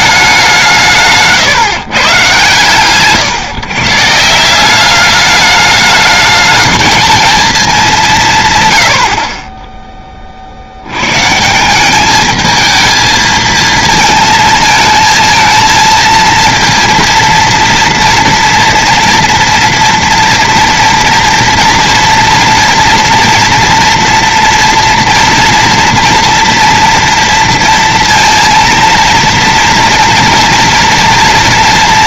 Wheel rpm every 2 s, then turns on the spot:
190, 130, 160, 220, 140, 50, 220, 220, 230, 230, 230, 230, 230, 230, 230, 230.
none